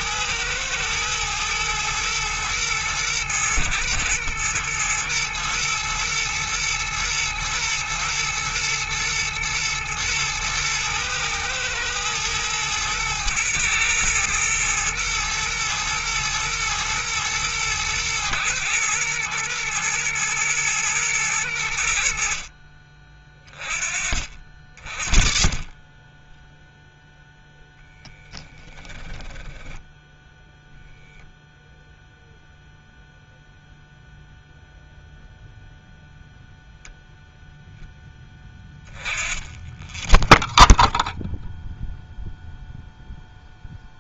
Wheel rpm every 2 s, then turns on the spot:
110, 110, 120, 110, 110, 110, 110, 110, 110, 110, 110, 40, 40, 0, 10, 0, 0, 0, 0, 10, 0, 0.
28-30